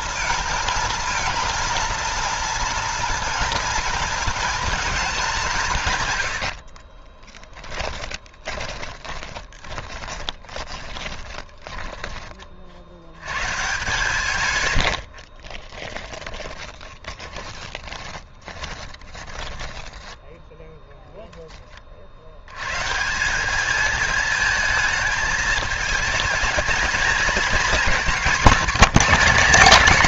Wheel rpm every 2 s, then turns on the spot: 230, 230, 230, 60, 20, 20, 50, 100, 20, 20, 0, 130, 220, 220, 260.
6-12 16-20